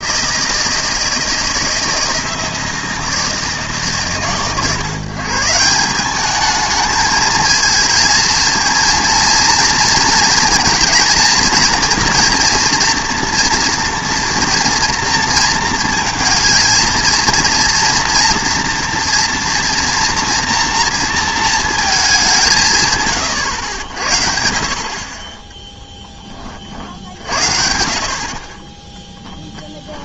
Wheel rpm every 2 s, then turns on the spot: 160, 160, 130, 210, 230, 230, 230, 230, 230, 230, 230, 160, 50, 50, 20.
28-30